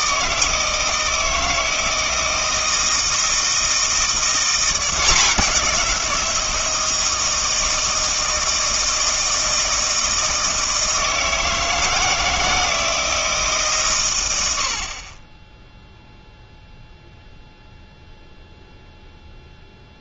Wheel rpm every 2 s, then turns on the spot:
160, 160, 180, 160, 160, 160, 160, 70, 0, 0.
none